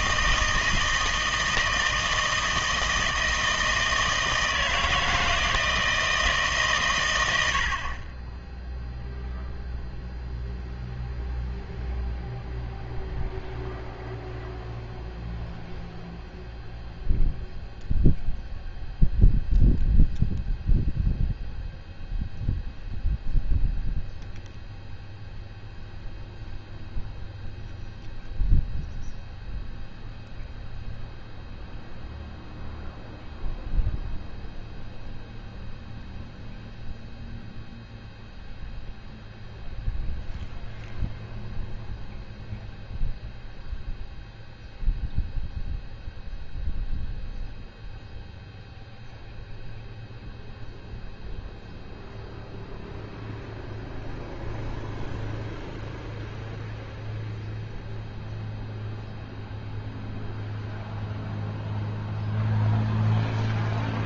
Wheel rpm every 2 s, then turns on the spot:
160, 160, 160, 120, 0, 0, 0, 0, 0, 0, 0, 0, 0, 0, 0, 0, 0, 0, 0, 0, 0, 0, 0, 0, 0, 0, 0, 0, 0, 0, 0, 0.
none